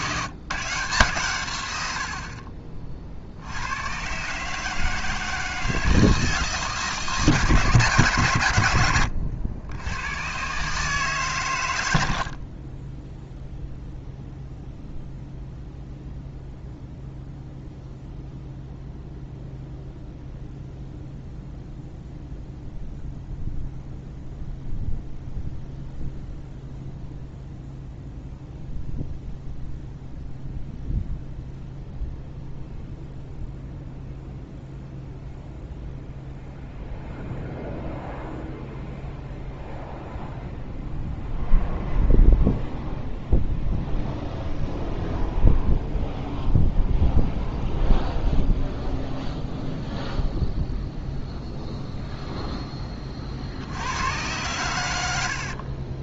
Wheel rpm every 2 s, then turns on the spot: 150, 40, 150, 160, 110, 140, 30, 0, 0, 0, 0, 0, 0, 0, 0, 0, 0, 0, 0, 0, 0, 0, 0, 0, 0, 0, 10, 100.
12-14